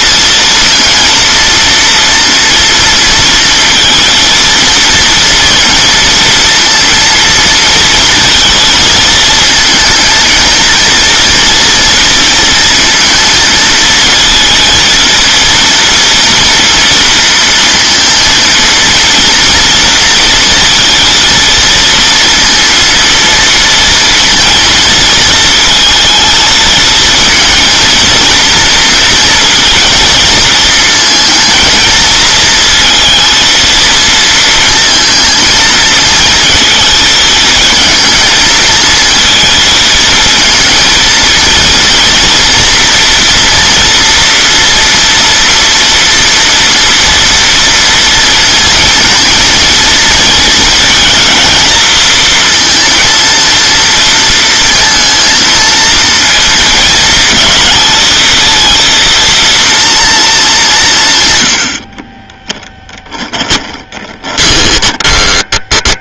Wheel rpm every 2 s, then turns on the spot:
230, 230, 230, 230, 230, 230, 230, 230, 230, 230, 230, 230, 230, 230, 230, 230, 230, 230, 230, 220, 230, 240, 230, 230, 230, 230, 230, 230, 220, 230, 190, 10, 20.
62-66